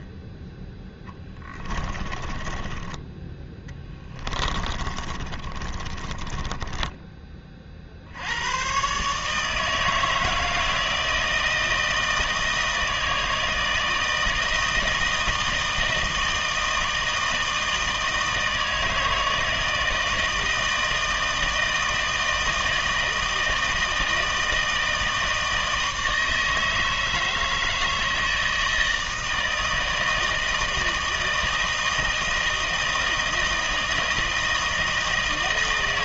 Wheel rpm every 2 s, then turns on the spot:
10, 20, 30, 20, 120, 160, 160, 160, 160, 160, 160, 160, 160, 160, 160, 160, 160, 160.
2-8